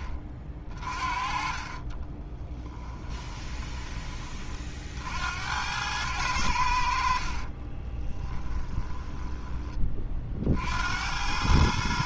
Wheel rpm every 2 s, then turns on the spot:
30, 10, 50, 80, 10, 80.
2-4 8-10